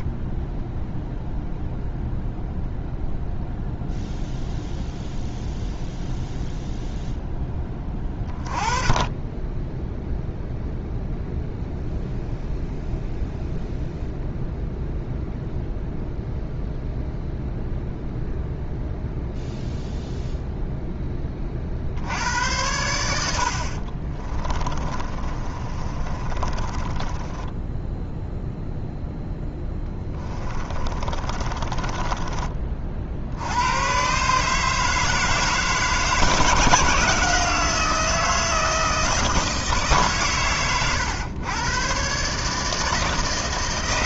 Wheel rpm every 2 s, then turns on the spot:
0, 0, 0, 0, 20, 0, 0, 0, 0, 0, 10, 90, 20, 20, 0, 20, 40, 150, 160, 160, 110, 160.
24-28 30-32